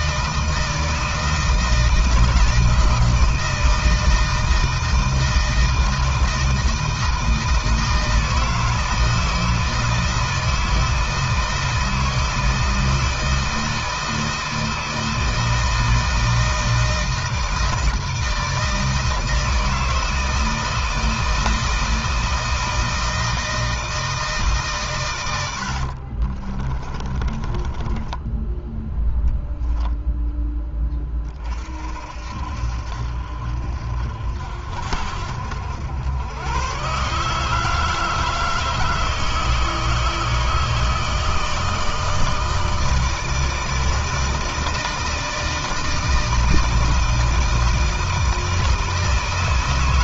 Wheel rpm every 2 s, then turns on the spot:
160, 170, 160, 160, 160, 160, 160, 160, 160, 160, 160, 160, 150, 30, 10, 10, 60, 60, 110, 160, 160, 160, 160, 160, 160.
26-30